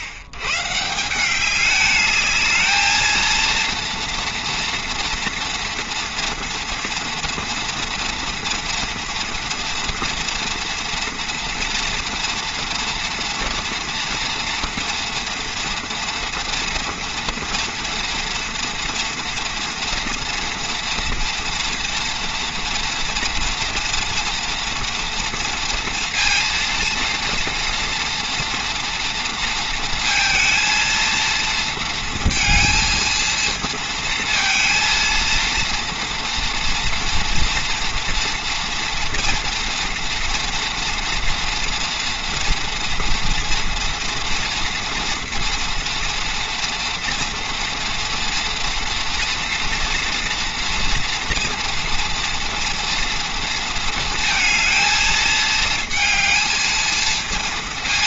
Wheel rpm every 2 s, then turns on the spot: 120, 220, 230, 230, 230, 230, 230, 230, 230, 230, 240, 230, 230, 230, 230, 230, 230, 230, 230, 230, 230, 230, 240, 240, 230, 230, 230, 220, 230.
none